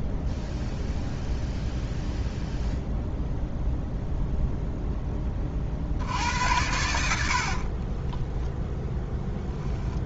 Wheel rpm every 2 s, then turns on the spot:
0, 0, 0, 80, 10.
8-10